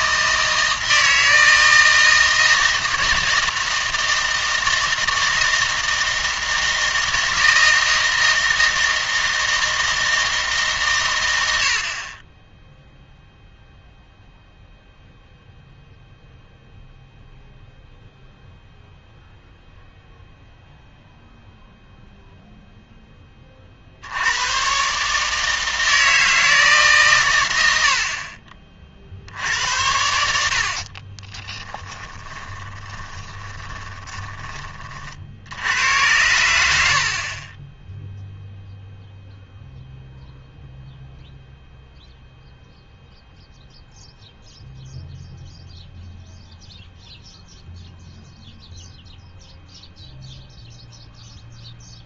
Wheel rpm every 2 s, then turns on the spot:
160, 160, 160, 160, 160, 140, 0, 0, 0, 0, 0, 0, 130, 150, 40, 50, 20, 40, 80, 0, 0, 0, 0, 0, 0, 0.
32-34 36-38